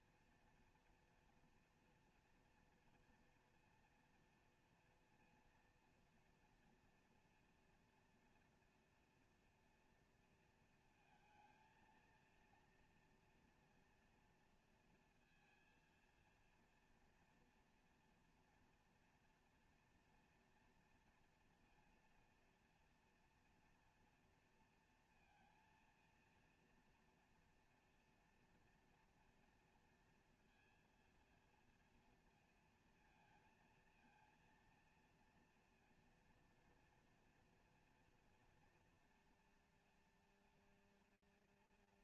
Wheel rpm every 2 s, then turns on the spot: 240, 240, 230, 230, 230, 230, 230, 230, 230, 240, 230, 230, 230, 230, 230, 230, 230, 230, 230, 230, 220.
none